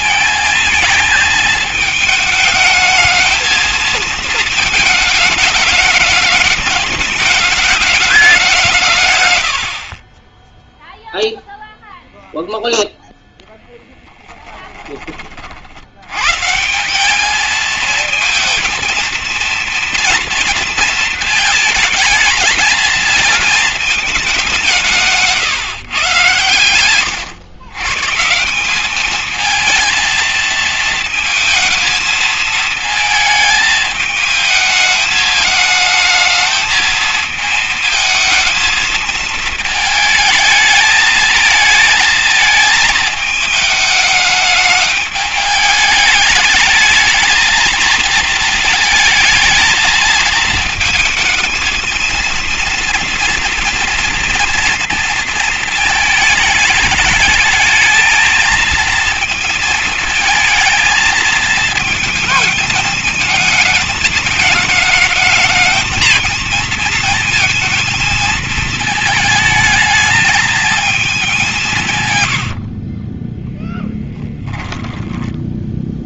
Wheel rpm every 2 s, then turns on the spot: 220, 220, 220, 210, 150, 0, 0, 20, 190, 230, 220, 220, 160, 100, 200, 220, 220, 220, 220, 220, 220, 210, 210, 220, 220, 220, 230, 230, 220, 230, 220, 220, 220, 220, 220, 220, 40, 10.
24-26 74-76